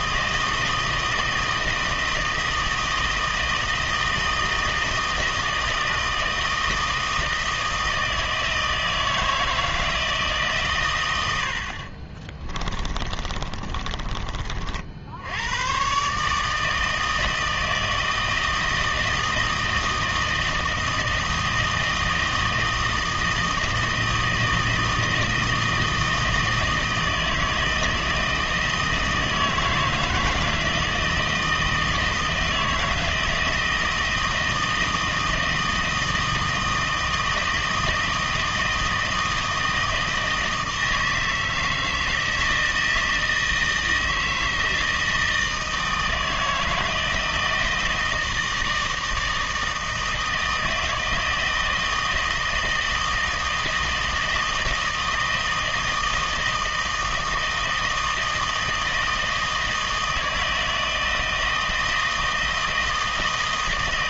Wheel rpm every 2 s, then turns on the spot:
160, 160, 160, 160, 160, 150, 30, 40, 160, 160, 160, 160, 160, 160, 160, 170, 160, 160, 160, 160, 160, 160, 160, 160, 160, 160, 160, 160, 160, 160, 160, 160.
12-14